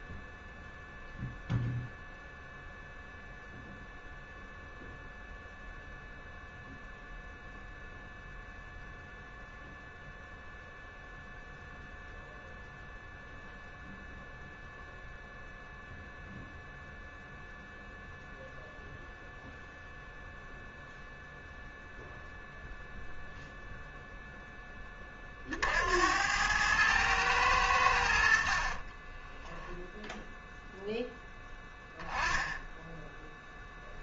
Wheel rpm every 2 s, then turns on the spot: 0, 0, 0, 0, 0, 0, 0, 0, 0, 0, 0, 0, 10, 100, 40, 0, 10.
28-30